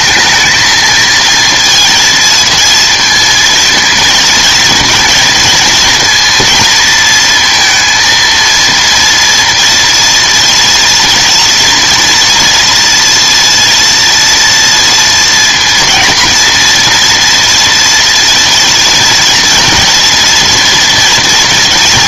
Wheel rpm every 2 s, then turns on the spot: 220, 230, 230, 230, 230, 230, 230, 230, 230, 240, 230.
none